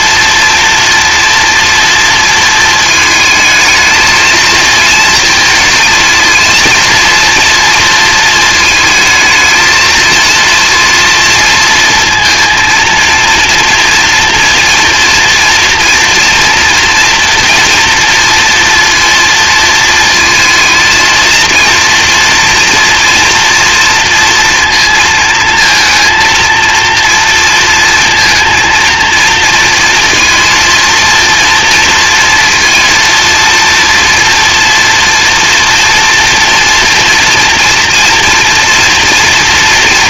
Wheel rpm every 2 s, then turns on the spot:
230, 220, 220, 230, 220, 230, 230, 230, 230, 230, 230, 240, 230, 230, 230, 230, 230, 230, 230, 240.
none